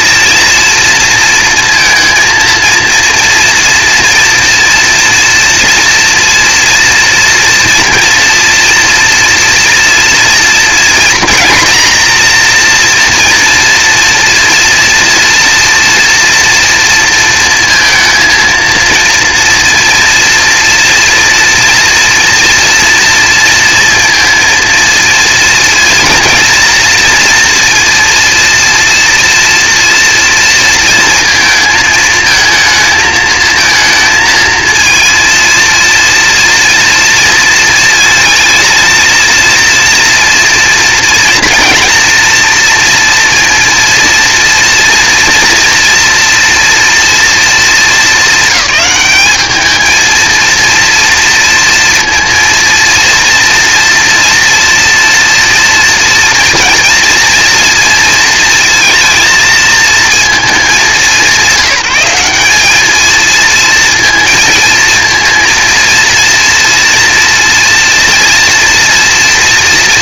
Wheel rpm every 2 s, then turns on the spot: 230, 230, 230, 230, 240, 230, 240, 230, 230, 230, 240, 240, 230, 230, 230, 230, 220, 220, 230, 230, 230, 230, 230, 230, 200, 230, 230, 240, 240, 230, 200, 210, 220, 230, 230.
none